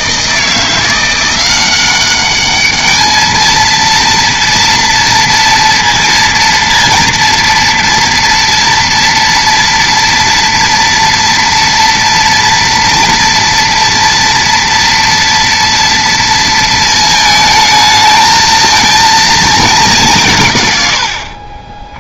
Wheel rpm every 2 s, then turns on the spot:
170, 210, 230, 230, 230, 230, 230, 230, 220, 230, 120.
none